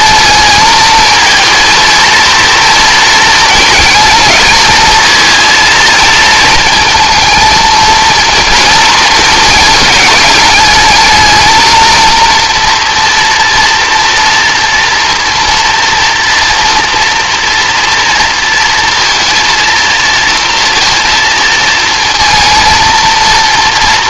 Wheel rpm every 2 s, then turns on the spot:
220, 230, 220, 220, 220, 220, 230, 240, 230, 230, 230, 230.
none